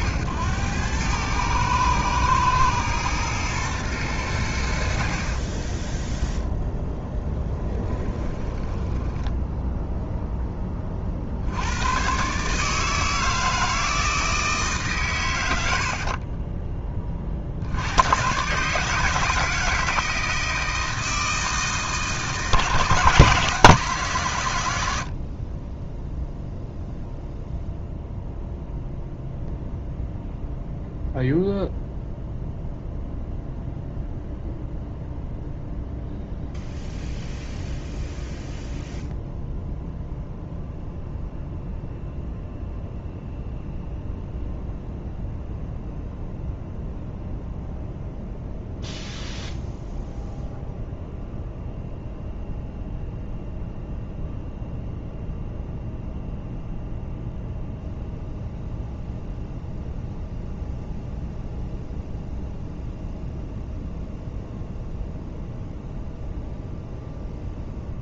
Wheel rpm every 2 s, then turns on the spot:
100, 110, 70, 10, 10, 30, 160, 130, 20, 150, 160, 150, 80, 0, 0, 0, 0, 0, 0, 0, 0, 0, 0, 0, 0, 0, 0, 0, 0, 0, 0, 0, 0, 0.
8-10